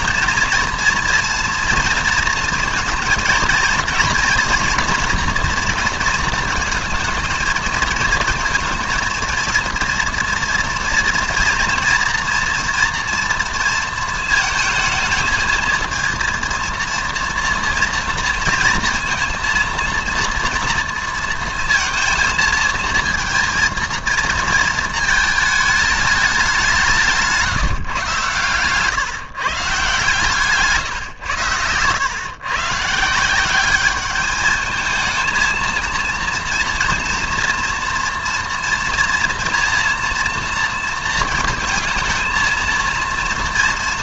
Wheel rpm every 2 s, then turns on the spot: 230, 230, 230, 220, 230, 230, 230, 220, 230, 230, 230, 220, 230, 190, 130, 150, 130, 220, 230, 230, 230, 230.
none